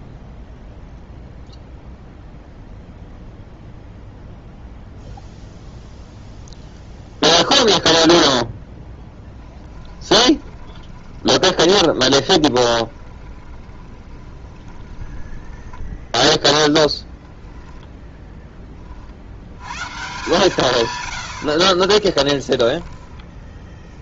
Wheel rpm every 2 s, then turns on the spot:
0, 0, 0, 0, 0, 20, 20, 20, 0, 30, 130, 10.
10-16 22-24